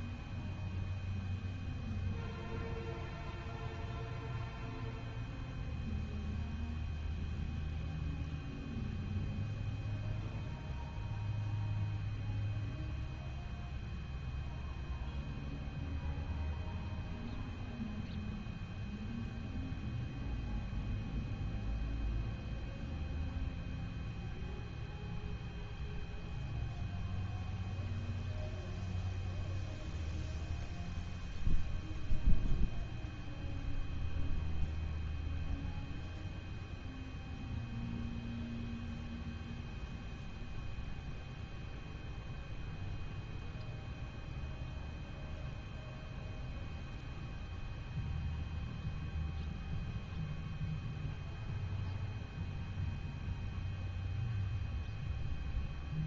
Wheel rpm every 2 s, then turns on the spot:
0, 0, 0, 0, 0, 0, 0, 0, 0, 0, 0, 0, 0, 0, 0, 0, 0, 0, 0, 0, 0, 0, 0, 0, 0, 0, 0, 0.
none